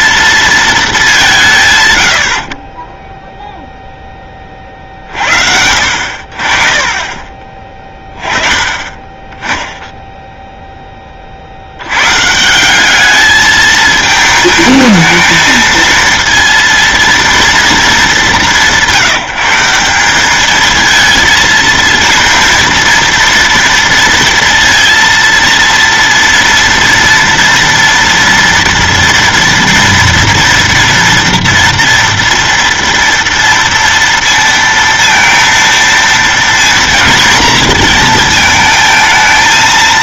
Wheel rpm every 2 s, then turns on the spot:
220, 30, 40, 40, 30, 10, 180, 220, 230, 180, 220, 230, 230, 230, 230, 230, 230, 230, 230, 220.
none